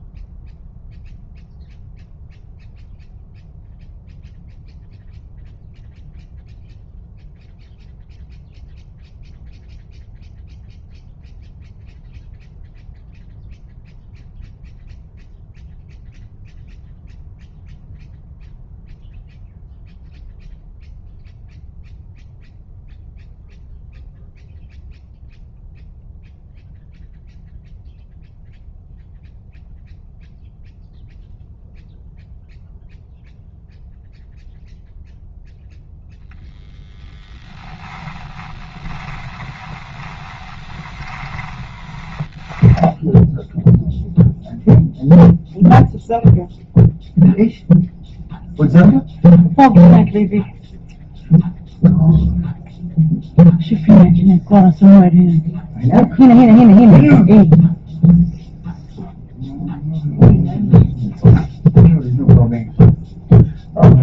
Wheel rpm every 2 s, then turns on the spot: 0, 0, 0, 0, 0, 0, 0, 0, 0, 0, 0, 0, 0, 0, 0, 0, 0, 0, 10, 20, 10, 10, 0, 0, 0, 0, 0, 0, 0, 0, 0, 0.
36-42